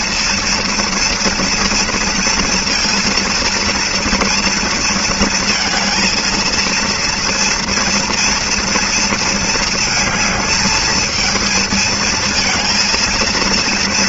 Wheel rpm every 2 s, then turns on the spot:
230, 230, 230, 230, 230, 220, 230.
none